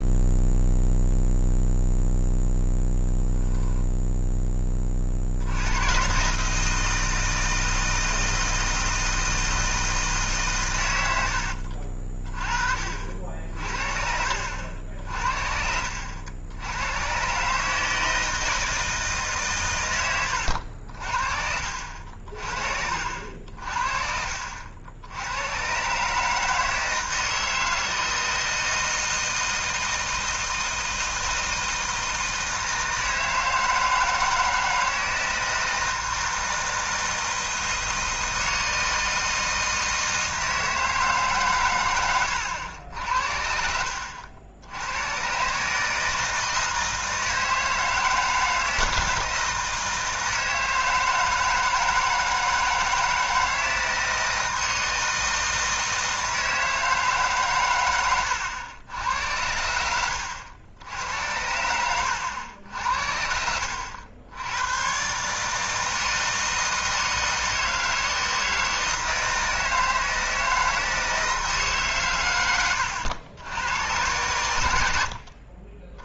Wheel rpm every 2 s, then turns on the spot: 0, 0, 20, 160, 160, 110, 50, 70, 100, 160, 60, 60, 70, 160, 160, 160, 160, 160, 160, 160, 160, 80, 90, 160, 160, 160, 160, 160, 160, 90, 90, 80, 110, 160, 160, 160, 100, 80.
12-14